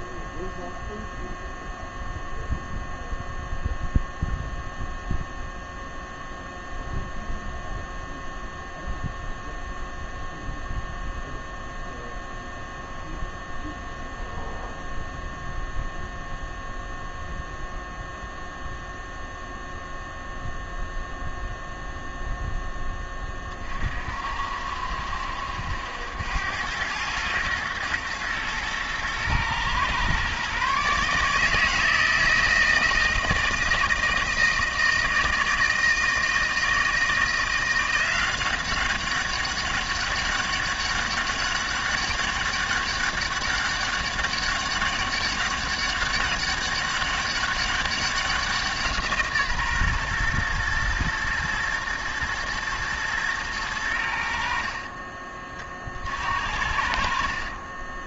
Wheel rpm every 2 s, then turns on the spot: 0, 0, 0, 0, 0, 0, 0, 0, 0, 0, 0, 10, 60, 100, 110, 140, 160, 160, 160, 190, 200, 200, 200, 200, 170, 120, 110, 40, 60.
54-56